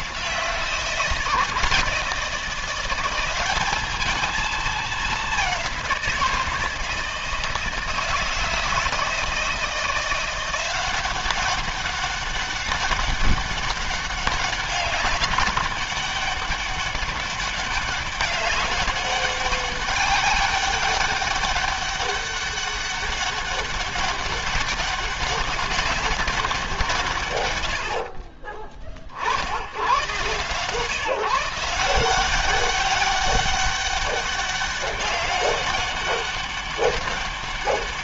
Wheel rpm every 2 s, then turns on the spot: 170, 180, 210, 160, 160, 180, 200, 200, 200, 200, 200, 200, 190, 170, 30, 140, 190, 200, 200.
none